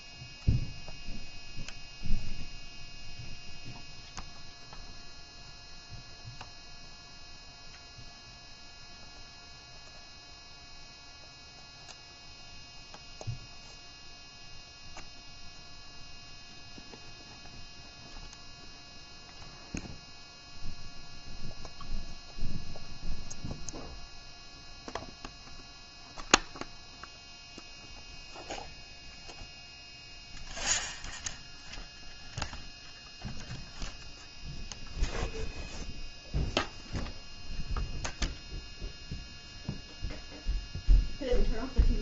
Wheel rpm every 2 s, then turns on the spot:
0, 0, 0, 0, 0, 0, 0, 0, 0, 0, 0, 0, 0, 0, 0, 0, 0, 0, 0, 0, 0.
none